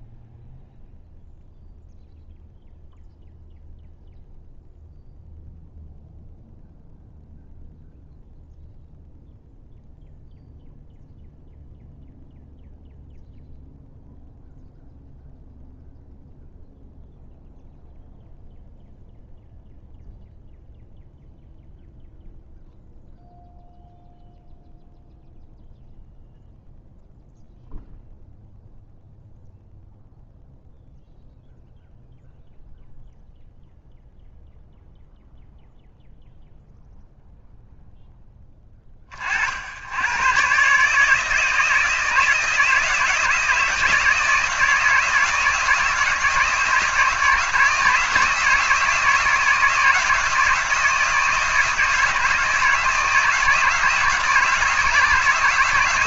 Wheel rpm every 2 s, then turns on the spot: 0, 0, 0, 0, 0, 0, 0, 0, 0, 0, 0, 0, 0, 0, 0, 0, 0, 0, 0, 60, 160, 160, 160, 160, 160, 160, 160, 160.
none